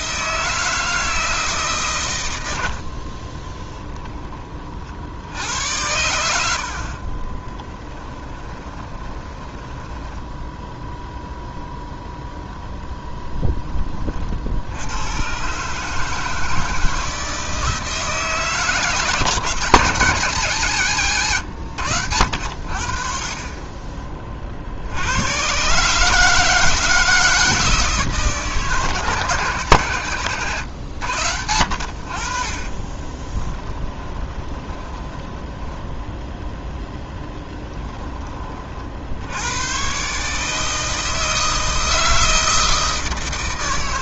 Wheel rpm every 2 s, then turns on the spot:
160, 60, 50, 50, 20, 0, 0, 90, 160, 150, 120, 40, 60, 160, 160, 120, 30, 20, 10, 50, 160, 160.
2-4 8-10 32-36